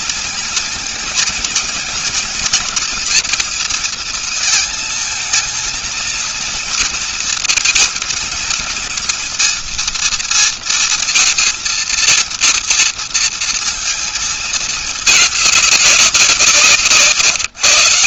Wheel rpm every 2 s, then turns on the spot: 230, 240, 220, 220, 230, 230, 230, 220, 180.
none